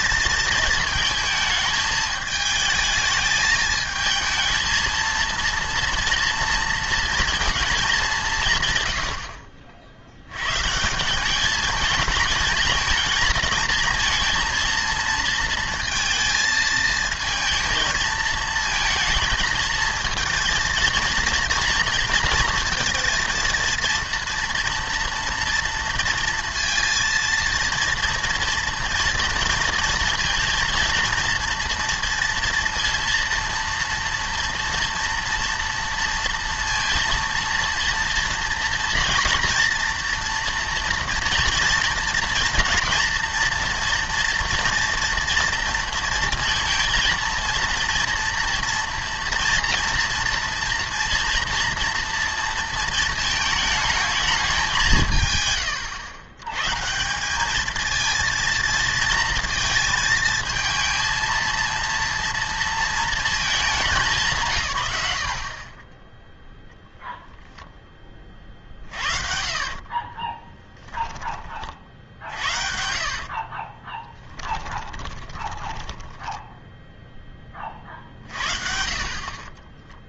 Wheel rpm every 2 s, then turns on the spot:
220, 220, 230, 230, 140, 150, 220, 220, 230, 220, 230, 230, 230, 230, 230, 230, 230, 240, 230, 240, 230, 240, 230, 230, 240, 240, 230, 180, 140, 230, 230, 230, 150, 0, 40, 20, 70, 20, 0, 50.
68-76